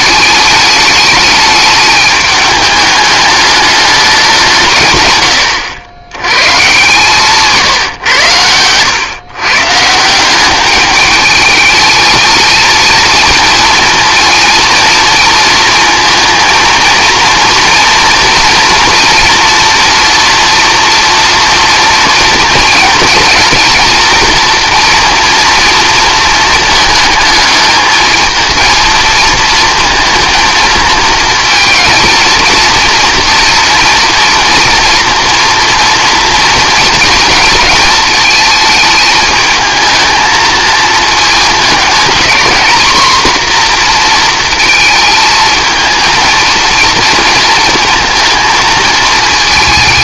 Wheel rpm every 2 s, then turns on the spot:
210, 210, 150, 140, 110, 200, 220, 230, 230, 230, 240, 230, 230, 220, 230, 220, 230, 230, 230, 220, 220, 240, 230, 230, 230.
none